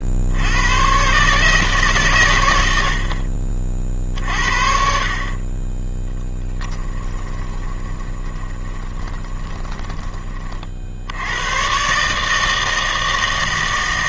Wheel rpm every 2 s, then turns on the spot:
100, 80, 50, 10, 20, 50, 160.
6-10